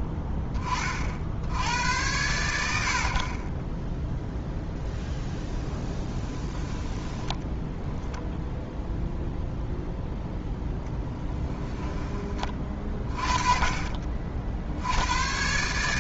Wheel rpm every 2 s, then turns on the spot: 30, 70, 0, 20, 0, 0, 30, 70.
6-8